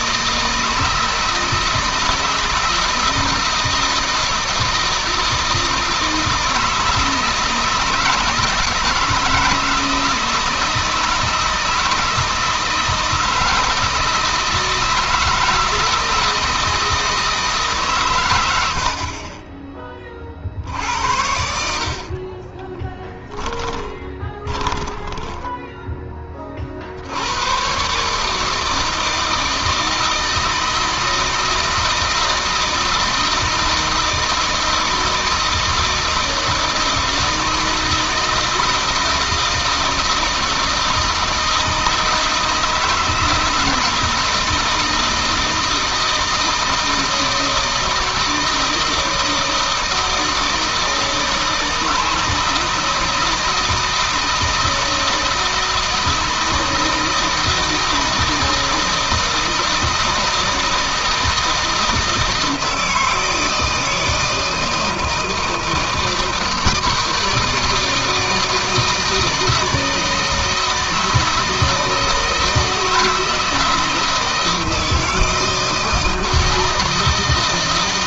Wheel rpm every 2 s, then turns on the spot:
160, 160, 160, 160, 160, 160, 160, 160, 160, 90, 50, 30, 20, 40, 150, 160, 160, 160, 160, 160, 160, 160, 160, 160, 160, 160, 160, 160, 160, 160, 160, 160, 160, 160, 160, 160, 160, 160, 160.
22-26